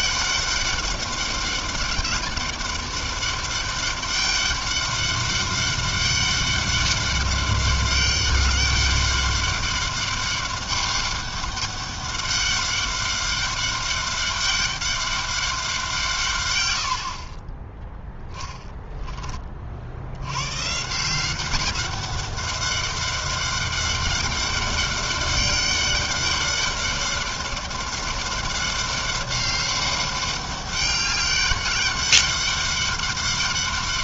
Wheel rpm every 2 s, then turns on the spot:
200, 200, 200, 200, 200, 200, 200, 200, 40, 30, 190, 200, 200, 200, 200, 200, 200.
none